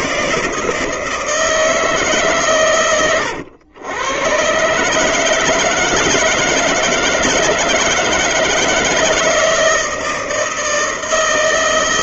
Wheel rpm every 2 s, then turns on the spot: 160, 130, 140, 160, 160, 160.
none